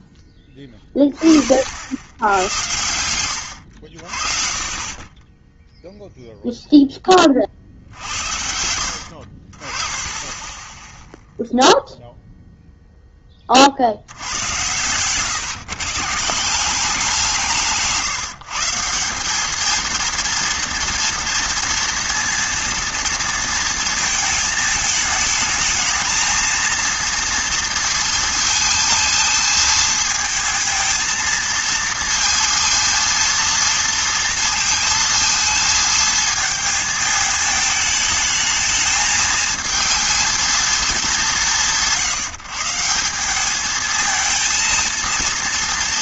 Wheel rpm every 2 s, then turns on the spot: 10, 90, 30, 0, 70, 10, 0, 110, 180, 160, 230, 230, 210, 230, 220, 220, 230, 230, 220, 220, 230, 160, 230.
14-16